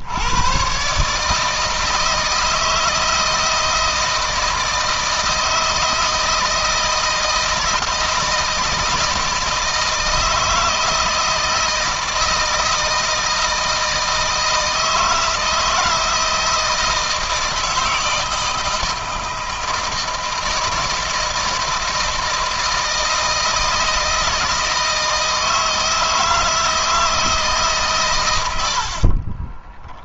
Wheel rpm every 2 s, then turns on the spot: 140, 160, 160, 160, 160, 160, 160, 160, 160, 160, 160, 160, 160, 160, 60.
28-30